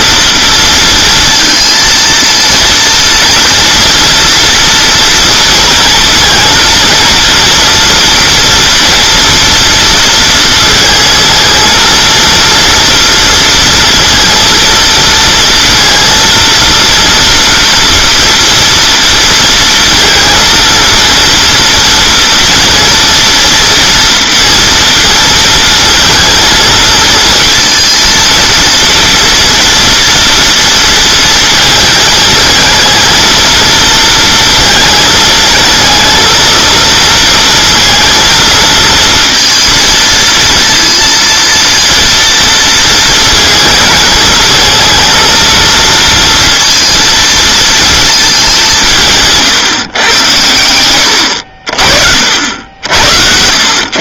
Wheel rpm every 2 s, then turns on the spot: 230, 230, 230, 230, 230, 220, 230, 230, 230, 230, 230, 230, 230, 230, 230, 230, 220, 230, 230, 230, 230, 230, 220, 230, 190, 100, 80.
none